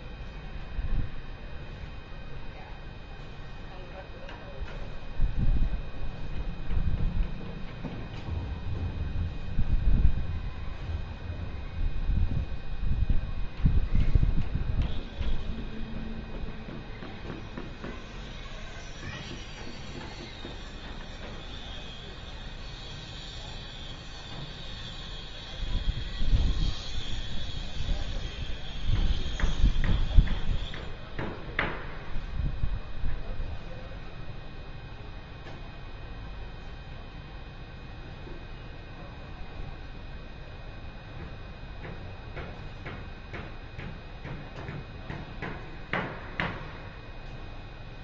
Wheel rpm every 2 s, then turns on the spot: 0, 0, 0, 0, 0, 0, 0, 0, 0, 0, 0, 0, 0, 0, 0, 0, 0, 0, 0, 0, 0, 0, 0, 0.
none